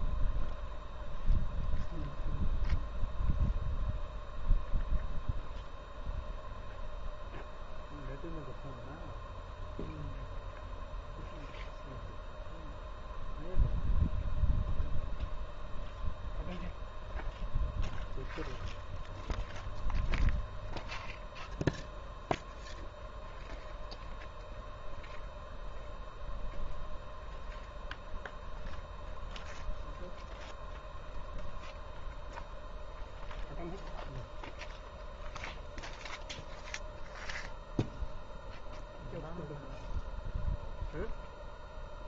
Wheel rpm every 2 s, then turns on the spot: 0, 0, 0, 0, 0, 0, 0, 0, 0, 0, 0, 0, 0, 0, 0, 0, 0, 0, 0, 0, 0.
none